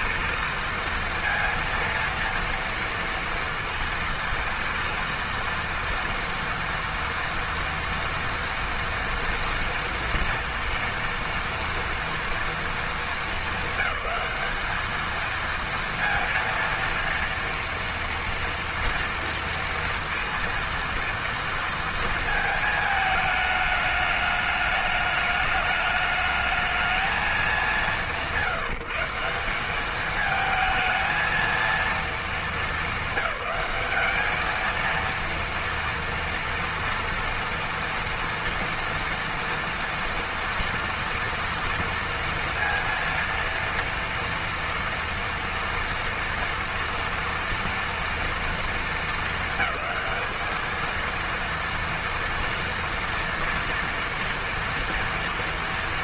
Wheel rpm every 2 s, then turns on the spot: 230, 230, 230, 240, 230, 230, 230, 220, 230, 230, 230, 220, 210, 220, 160, 220, 220, 220, 230, 230, 240, 230, 230, 230, 220, 220, 230, 230.
none